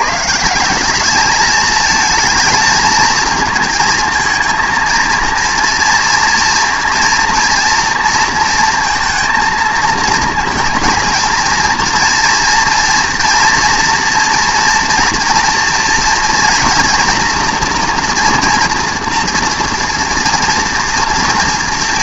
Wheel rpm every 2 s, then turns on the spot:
170, 220, 230, 230, 230, 230, 230, 230, 230, 230, 230.
none